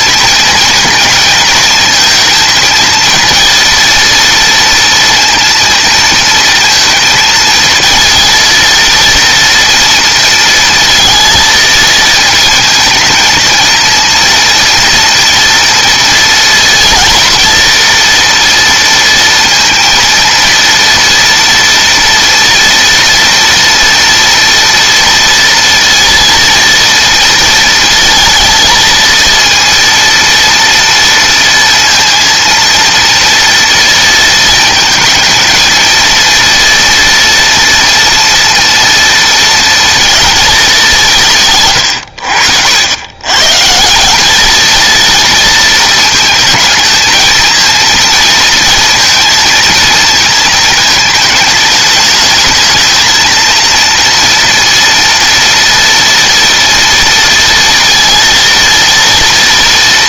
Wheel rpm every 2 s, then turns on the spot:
230, 220, 230, 230, 230, 230, 220, 230, 230, 230, 230, 230, 240, 230, 230, 230, 230, 230, 230, 230, 220, 80, 200, 220, 230, 230, 210, 230, 230, 230.
none